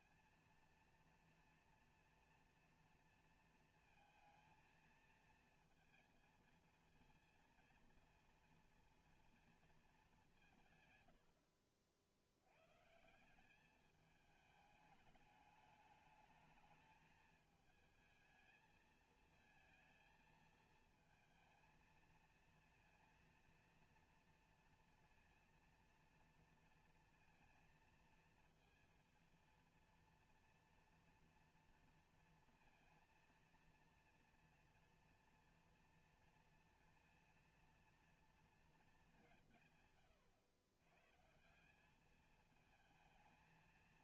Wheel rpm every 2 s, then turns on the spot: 230, 230, 230, 230, 230, 140, 120, 210, 220, 220, 220, 230, 230, 230, 230, 230, 230, 230, 230, 220, 110, 220.
none